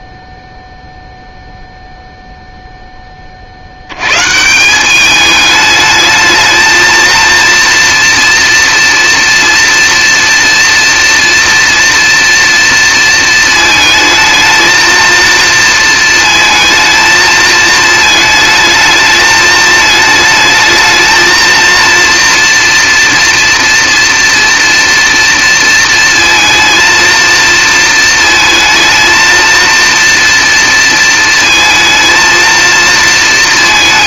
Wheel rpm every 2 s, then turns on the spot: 0, 0, 160, 220, 230, 230, 230, 230, 230, 220, 210, 230, 230, 230, 230, 230, 230.
none